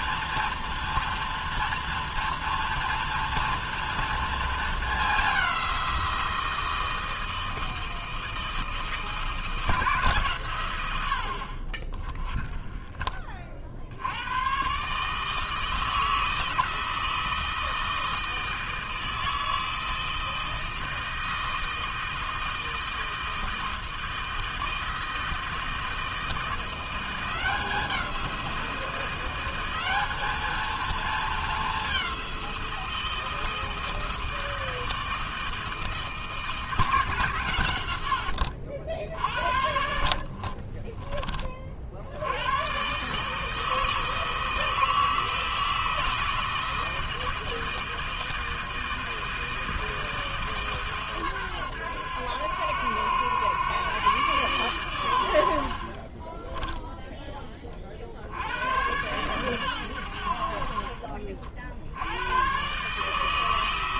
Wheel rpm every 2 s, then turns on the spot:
230, 230, 210, 160, 160, 90, 30, 150, 160, 160, 160, 160, 160, 180, 180, 220, 170, 160, 160, 60, 20, 130, 160, 160, 160, 140, 90, 110, 10, 110, 50, 140.
12-14 40-42 56-58